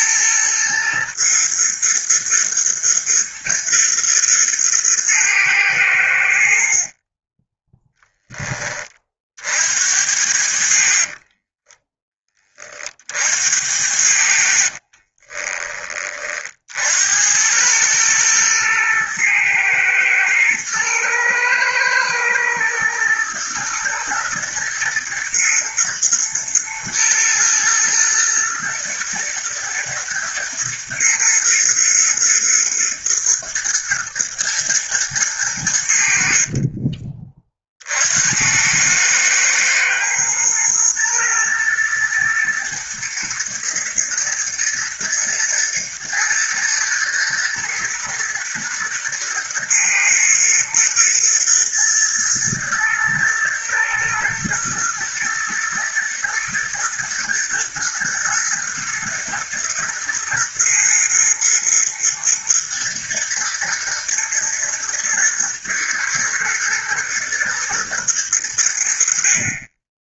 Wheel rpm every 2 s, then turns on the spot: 110, 110, 110, 50, 30, 50, 50, 30, 80, 110, 110, 110, 110, 110, 110, 120, 110, 110, 30, 100, 110, 110, 120, 110, 110, 120, 120, 110, 120, 110, 110, 120, 120, 120, 60.
6-8 10-12 14-16